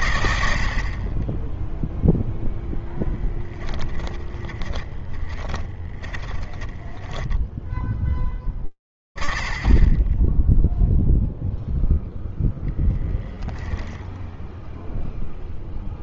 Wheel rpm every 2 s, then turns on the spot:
30, 10, 20, 10, 60, 10, 0, 0.
2-8